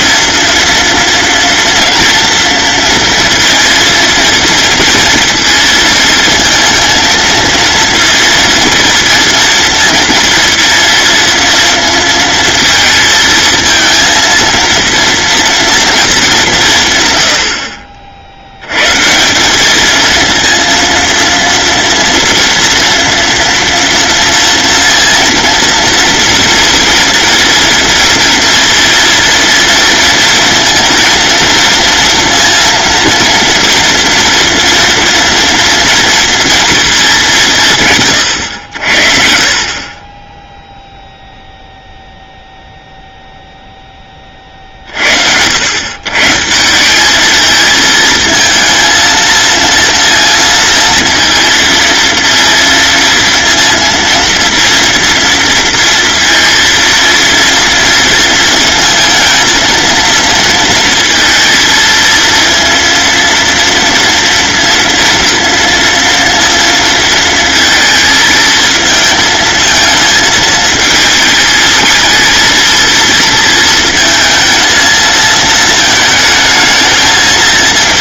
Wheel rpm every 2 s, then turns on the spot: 230, 230, 230, 230, 230, 230, 230, 230, 150, 120, 230, 230, 230, 230, 230, 230, 230, 230, 220, 70, 0, 0, 60, 190, 230, 230, 230, 230, 230, 230, 230, 230, 230, 230, 220, 220, 230, 230, 220.
none